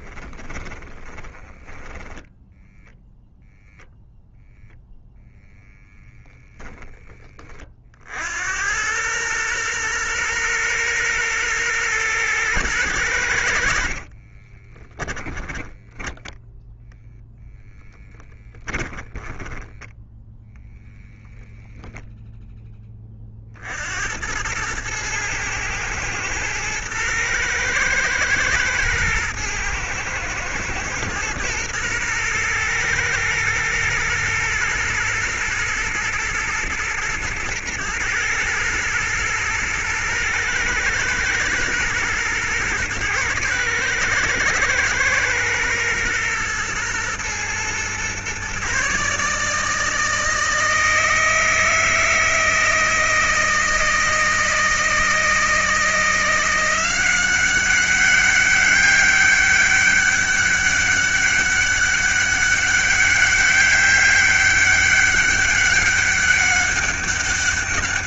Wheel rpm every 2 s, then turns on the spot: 20, 0, 0, 10, 90, 120, 110, 30, 0, 10, 0, 10, 110, 110, 120, 110, 120, 120, 110, 110, 110, 120, 120, 120, 140, 160, 160, 160, 180, 200, 200, 200, 200, 200.
0-2 14-16 18-20